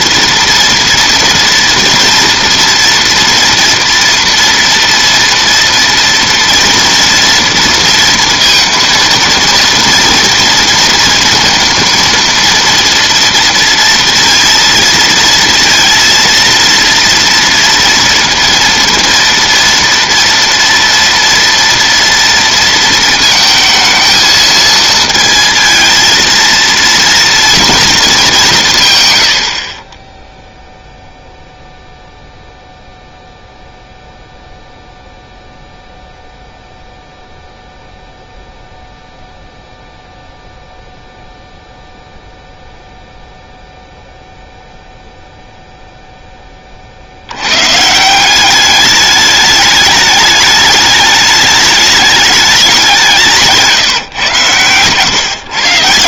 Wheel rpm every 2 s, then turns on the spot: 230, 230, 230, 230, 230, 230, 230, 230, 230, 230, 230, 230, 220, 230, 170, 0, 0, 0, 0, 0, 0, 0, 0, 30, 200, 210, 190, 130.
none